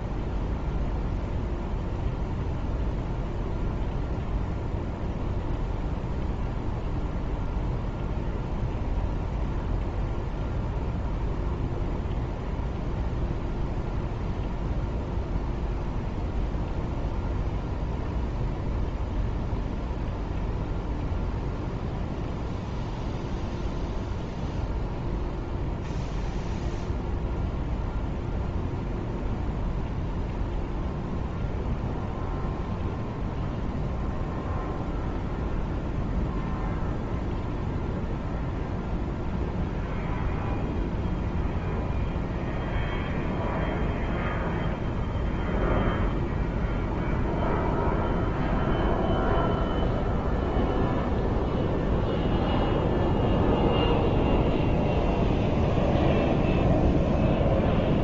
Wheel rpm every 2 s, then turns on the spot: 0, 0, 0, 0, 0, 0, 0, 0, 0, 0, 0, 0, 0, 0, 0, 0, 0, 0, 0, 0, 0, 0, 0, 0, 0, 0, 0, 0, 0.
none